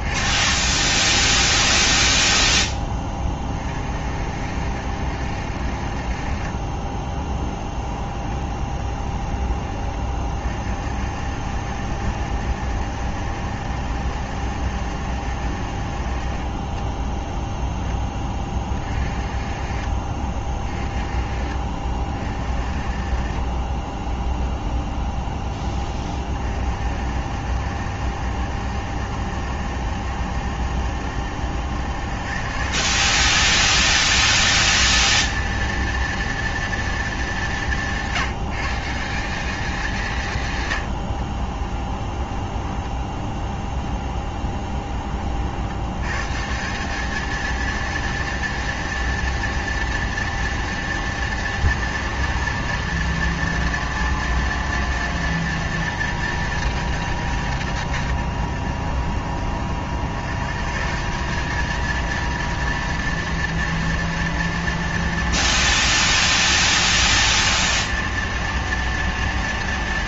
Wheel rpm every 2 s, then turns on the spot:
70, 10, 60, 30, 10, 40, 70, 70, 30, 20, 30, 40, 0, 30, 70, 70, 160, 230, 230, 170, 130, 20, 20, 160, 230, 230, 230, 230, 210, 100, 150, 230, 230, 230, 230.
8-10 44-46